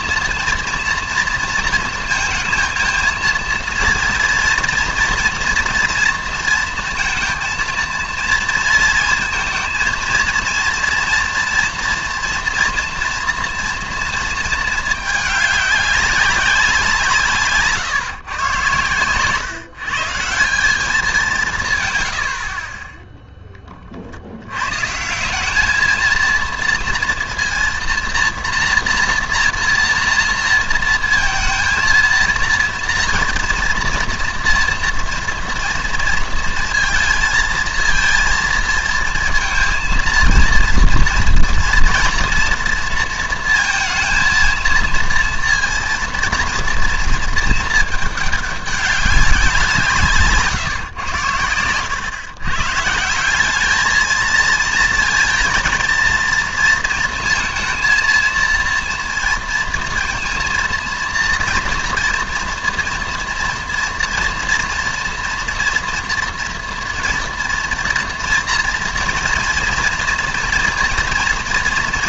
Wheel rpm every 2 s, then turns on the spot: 230, 230, 230, 230, 230, 230, 240, 220, 190, 120, 180, 40, 110, 230, 230, 230, 230, 230, 230, 230, 230, 230, 230, 230, 200, 140, 130, 230, 230, 230, 230, 230, 230, 230, 230, 230.
none